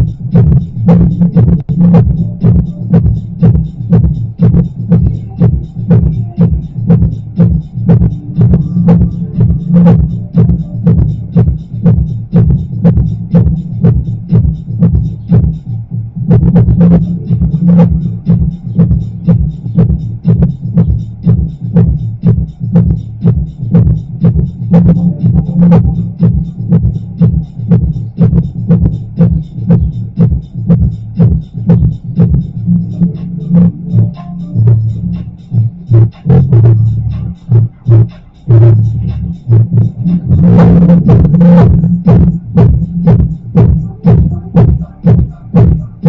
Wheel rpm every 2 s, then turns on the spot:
0, 0, 0, 0, 0, 0, 0, 0, 0, 0, 0, 0, 0, 0, 0, 0, 0, 0, 0, 0, 0, 0, 0.
none